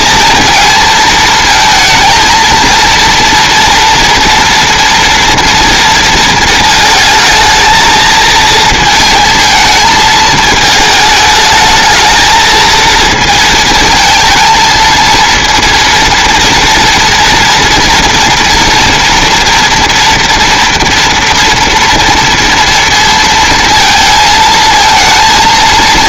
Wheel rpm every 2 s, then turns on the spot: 220, 230, 230, 220, 220, 220, 230, 230, 230, 240, 230, 230, 220.
none